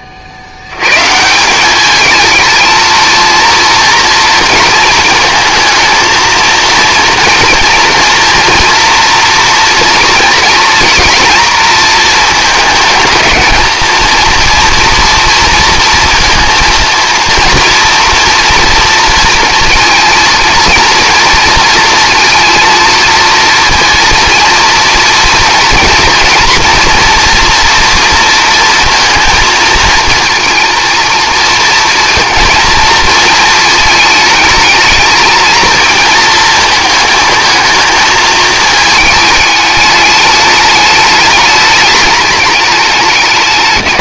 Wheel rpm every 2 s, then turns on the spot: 80, 220, 230, 230, 240, 230, 230, 230, 230, 230, 230, 230, 230, 230, 230, 230, 230, 220, 230, 220, 210, 200.
none